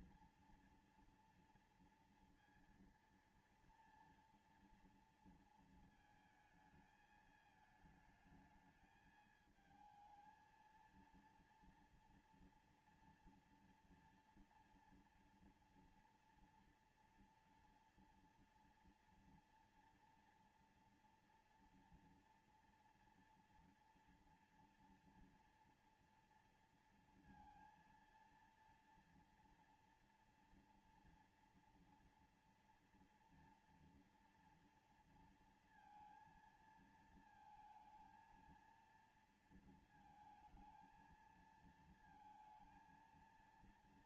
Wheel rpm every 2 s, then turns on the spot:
240, 230, 230, 220, 220, 220, 230, 230, 230, 230, 230, 230, 230, 230, 230, 230, 230, 230, 230, 220, 220, 220.
none